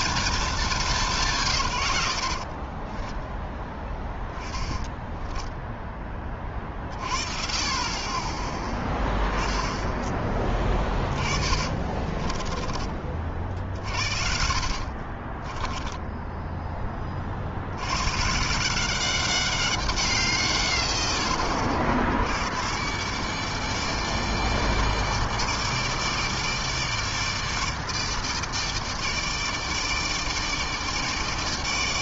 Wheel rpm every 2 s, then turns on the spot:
150, 10, 10, 30, 10, 30, 50, 40, 50, 190, 80, 150, 150, 150, 150, 150.
4-6 10-12 14-16